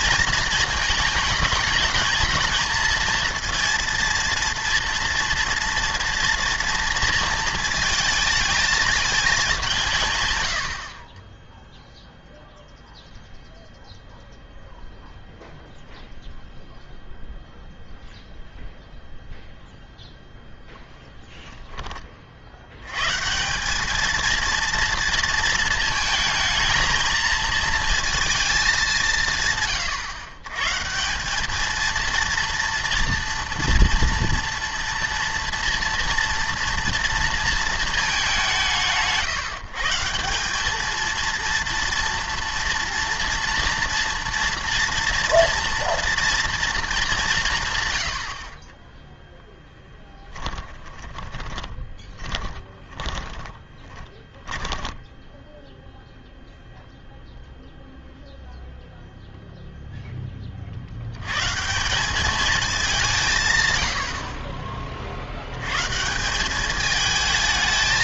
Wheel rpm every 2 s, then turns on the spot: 220, 220, 230, 230, 220, 80, 0, 0, 0, 0, 10, 80, 230, 220, 200, 140, 230, 230, 240, 180, 210, 240, 230, 230, 20, 20, 10, 10, 0, 0, 50, 200, 30, 210.
50-56